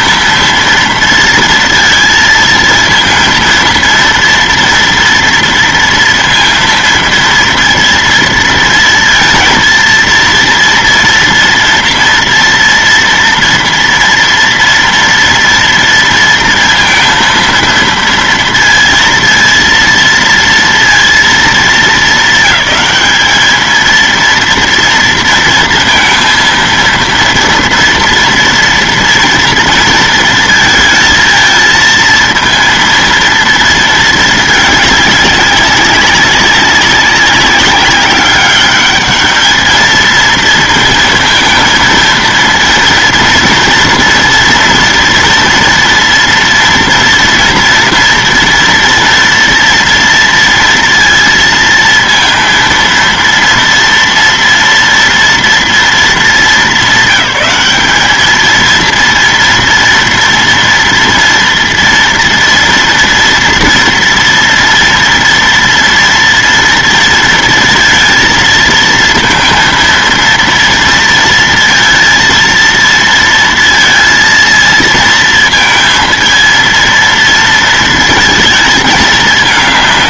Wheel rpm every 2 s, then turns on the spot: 230, 230, 230, 230, 230, 230, 240, 230, 230, 230, 230, 220, 230, 230, 230, 220, 230, 210, 190, 200, 230, 230, 230, 230, 230, 230, 230, 230, 200, 230, 230, 230, 230, 230, 230, 230, 230, 230, 230, 220.
none